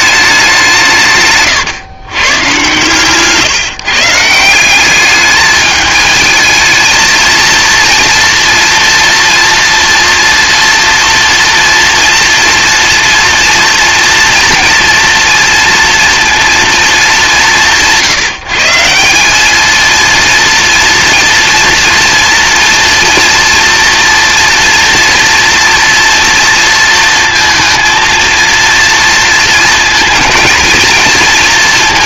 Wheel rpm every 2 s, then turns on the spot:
170, 130, 190, 220, 230, 230, 230, 230, 220, 170, 230, 230, 230, 230, 230, 230.
none